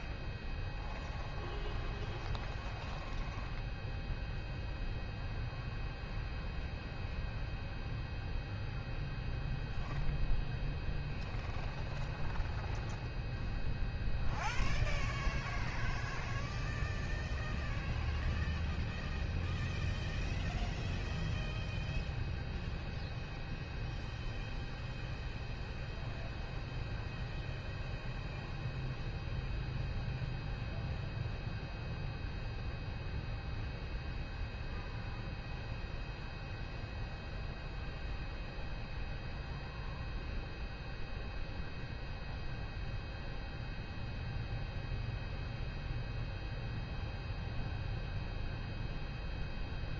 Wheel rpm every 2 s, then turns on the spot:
0, 0, 0, 0, 0, 0, 0, 0, 0, 0, 0, 0, 0, 0, 0, 0, 0, 0, 0, 0, 0, 0, 0, 0, 0.
none